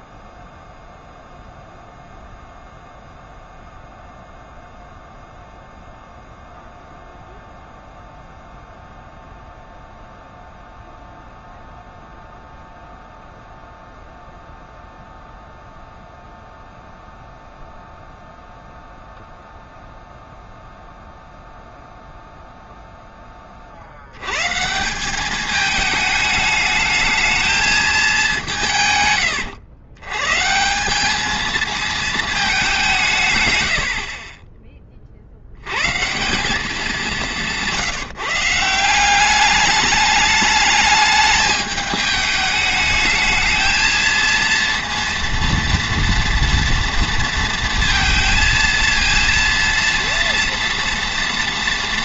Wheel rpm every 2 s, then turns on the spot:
0, 0, 0, 0, 0, 0, 0, 0, 0, 0, 0, 0, 160, 210, 170, 170, 200, 20, 190, 170, 210, 210, 230, 230, 230, 230.
none